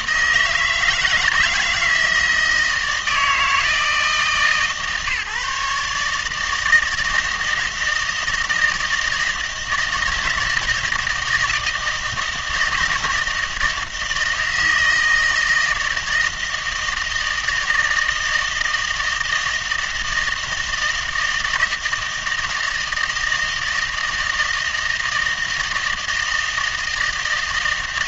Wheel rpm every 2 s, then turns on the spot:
160, 160, 150, 160, 160, 160, 160, 160, 160, 160, 160, 160, 160, 160.
none